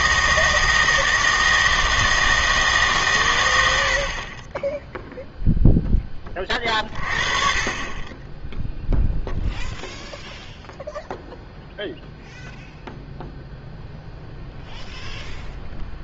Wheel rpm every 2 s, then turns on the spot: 160, 150, 10, 30, 0, 0, 0, 0.
none